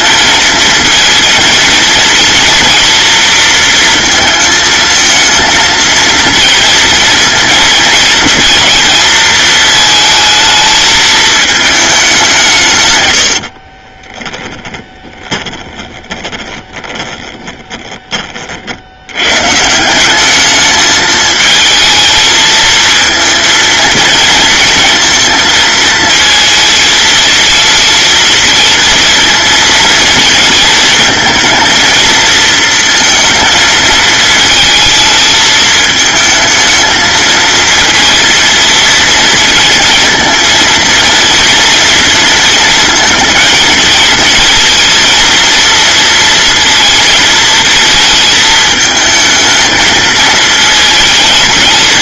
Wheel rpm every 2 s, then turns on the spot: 230, 230, 220, 230, 230, 220, 120, 10, 40, 80, 210, 220, 230, 230, 230, 230, 230, 220, 220, 220, 230, 220, 230, 230, 220, 220.
14-18